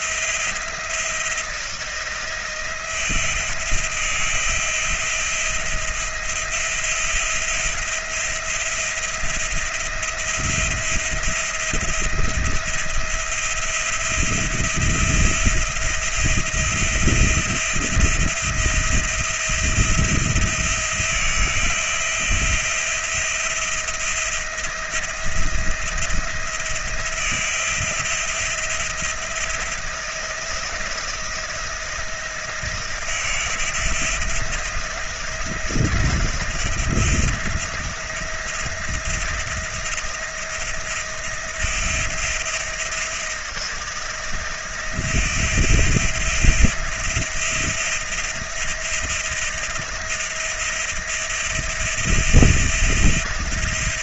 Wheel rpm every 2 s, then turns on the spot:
170, 170, 170, 170, 170, 170, 170, 170, 170, 170, 170, 170, 170, 170, 170, 160, 170, 170, 160, 170, 170, 170, 160, 160, 170, 160, 170.
none